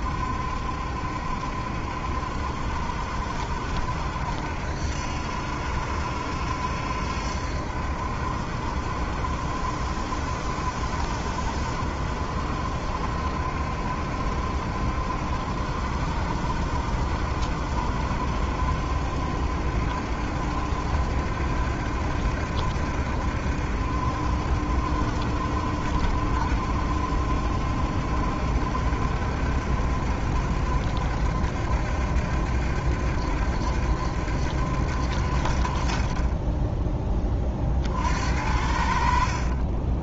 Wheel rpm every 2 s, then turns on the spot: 70, 70, 70, 70, 70, 70, 70, 70, 70, 70, 70, 70, 70, 70, 70, 70, 70, 70, 20, 70.
none